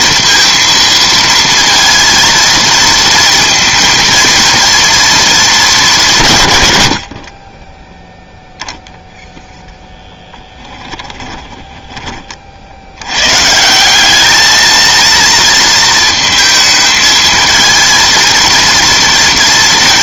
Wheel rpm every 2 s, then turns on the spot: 230, 230, 230, 120, 0, 10, 70, 220, 220, 230.
10-12